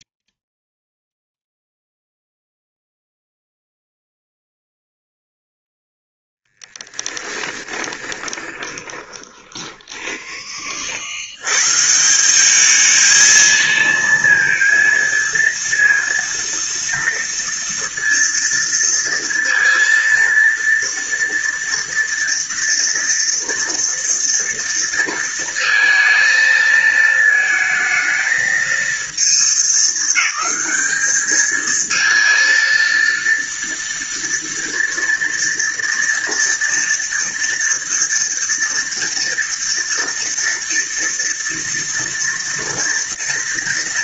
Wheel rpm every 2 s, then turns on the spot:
0, 0, 0, 0, 20, 20, 180, 230, 230, 230, 230, 230, 230, 220, 220, 210, 230, 230, 230, 230, 230, 230.
8-10